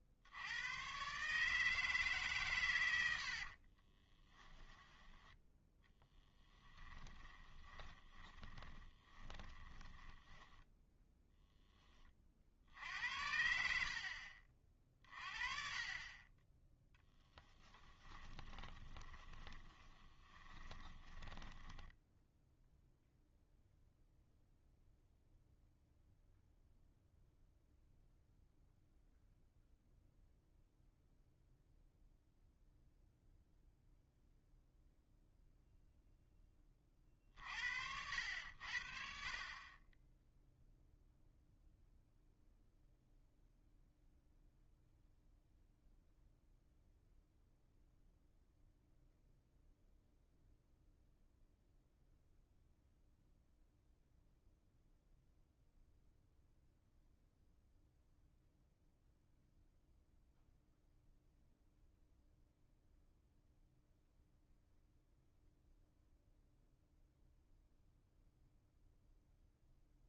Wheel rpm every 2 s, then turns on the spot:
110, 110, 10, 10, 20, 10, 70, 50, 10, 20, 20, 0, 0, 0, 0, 0, 0, 0, 30, 60, 0, 0, 0, 0, 0, 0, 0, 0, 0, 0, 0, 0, 0, 0, 0.
4-12 16-22